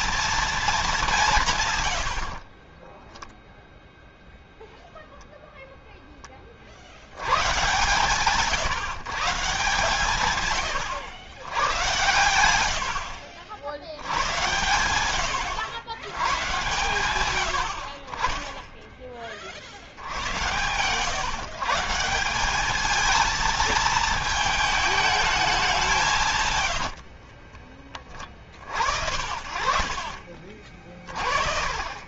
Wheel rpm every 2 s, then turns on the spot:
220, 50, 0, 40, 150, 120, 90, 100, 110, 0, 110, 190, 220, 100, 50, 30.
2-4 26-28